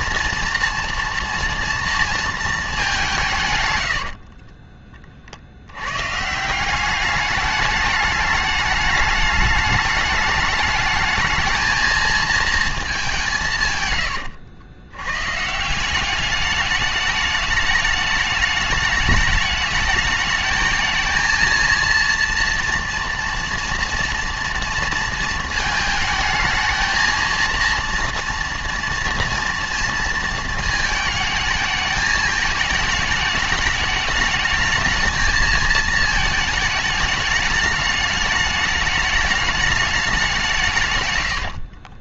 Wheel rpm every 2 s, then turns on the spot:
240, 170, 40, 200, 210, 210, 180, 130, 210, 210, 220, 230, 220, 220, 230, 220, 210, 220, 210, 210, 100.
none